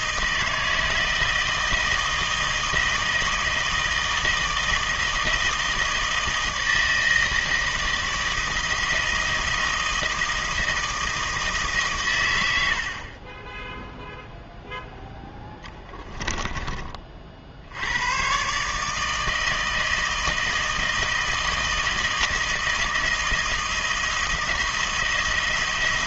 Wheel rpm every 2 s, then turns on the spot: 160, 160, 160, 160, 160, 160, 80, 0, 20, 140, 160, 160, 170.
none